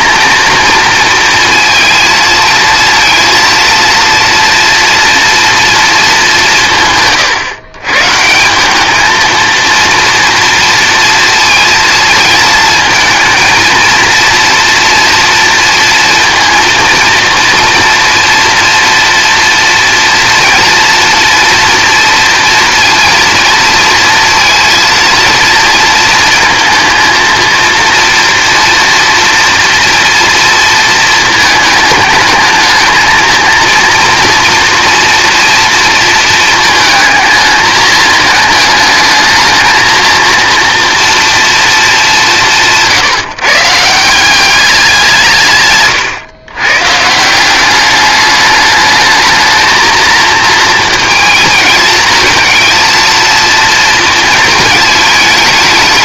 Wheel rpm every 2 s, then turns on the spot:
230, 230, 230, 160, 190, 230, 230, 240, 230, 230, 230, 230, 230, 230, 230, 230, 220, 230, 220, 210, 230, 160, 190, 130, 210, 220, 220, 220.
none